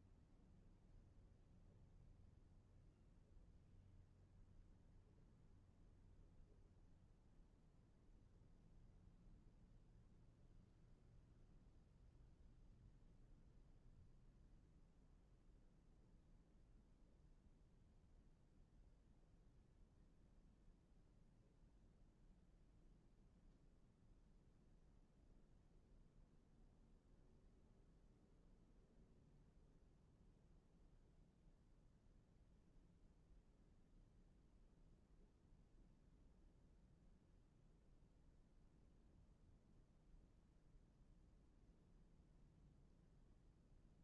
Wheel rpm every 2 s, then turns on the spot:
0, 0, 0, 0, 0, 0, 0, 0, 0, 0, 0, 0, 0, 0, 0, 0, 0, 0, 0, 0, 0, 0.
none